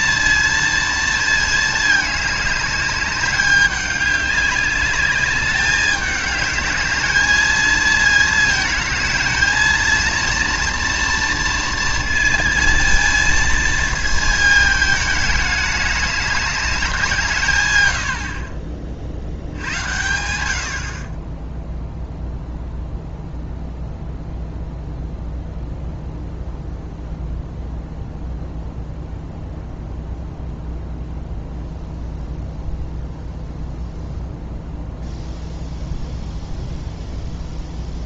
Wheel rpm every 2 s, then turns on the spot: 230, 210, 210, 210, 220, 230, 230, 220, 200, 40, 70, 0, 0, 0, 0, 0, 0, 0, 0.
none